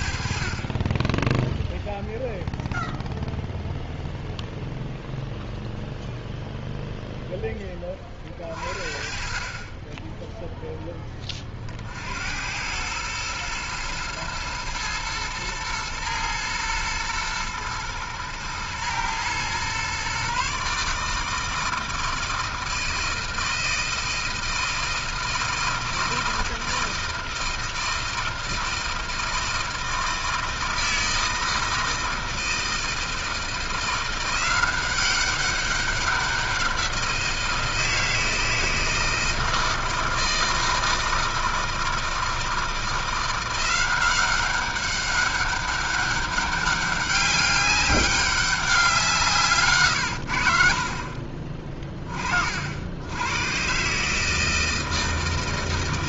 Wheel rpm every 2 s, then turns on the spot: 30, 0, 0, 0, 40, 0, 100, 110, 110, 110, 140, 160, 160, 160, 160, 160, 160, 180, 180, 160, 160, 160, 190, 200, 190, 70, 50, 160.
none